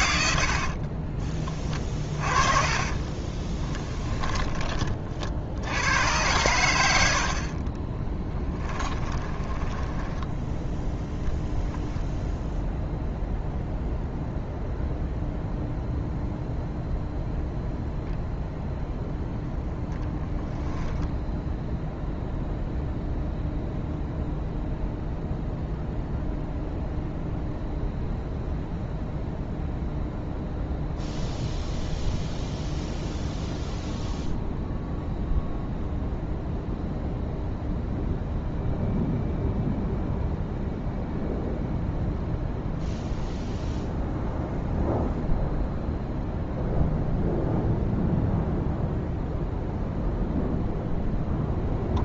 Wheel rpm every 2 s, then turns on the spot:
70, 30, 30, 100, 10, 0, 0, 0, 0, 0, 10, 0, 0, 0, 0, 0, 0, 0, 0, 0, 0, 0, 0, 0, 0, 0.
0-4 8-10 20-22